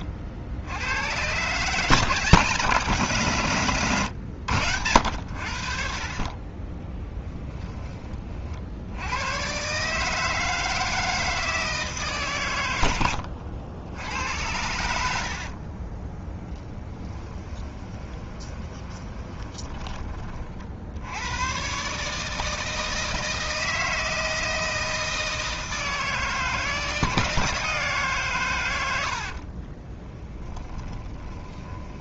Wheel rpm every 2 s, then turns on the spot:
90, 170, 100, 20, 70, 160, 100, 80, 10, 20, 70, 160, 160, 160, 100, 10.
16-20 30-32